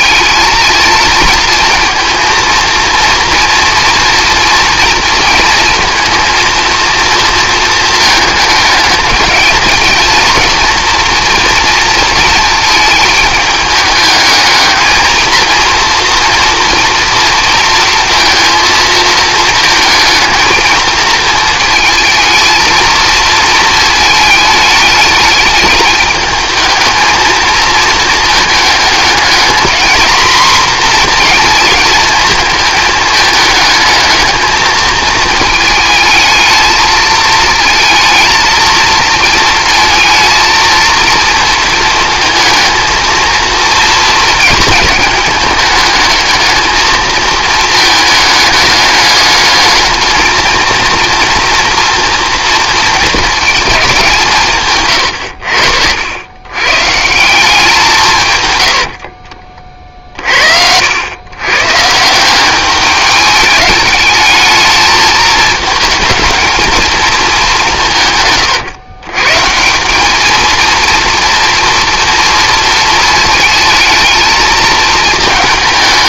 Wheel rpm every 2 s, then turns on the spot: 220, 230, 230, 230, 210, 230, 220, 220, 230, 220, 230, 230, 210, 220, 220, 240, 220, 220, 220, 220, 230, 230, 220, 220, 210, 230, 230, 120, 140, 80, 80, 200, 220, 230, 120, 230, 230, 220.
58-60